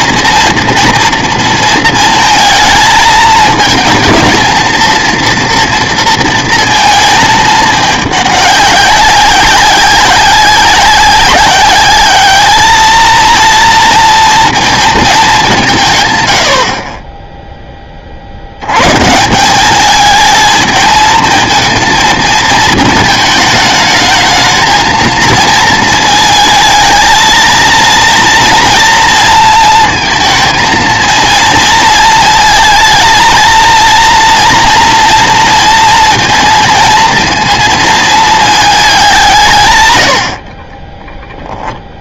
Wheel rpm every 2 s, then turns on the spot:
230, 220, 230, 230, 200, 200, 220, 230, 60, 100, 220, 220, 220, 220, 230, 230, 230, 230, 230, 210, 40.
none